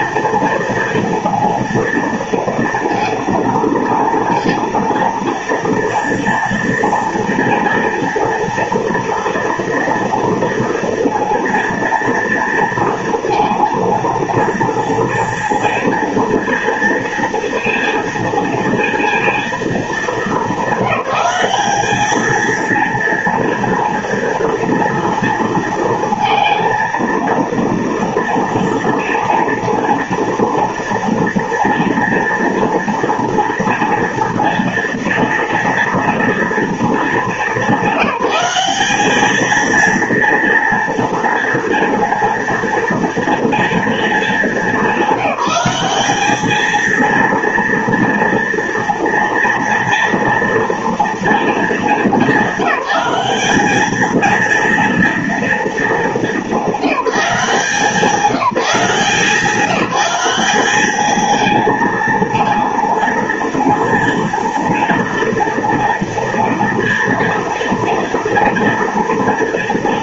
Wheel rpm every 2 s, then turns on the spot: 230, 230, 230, 230, 230, 230, 230, 230, 230, 230, 220, 230, 230, 230, 230, 230, 230, 230, 230, 190, 230, 230, 210, 210, 230, 230, 210, 230, 210, 180, 200, 230, 230, 230, 230.
none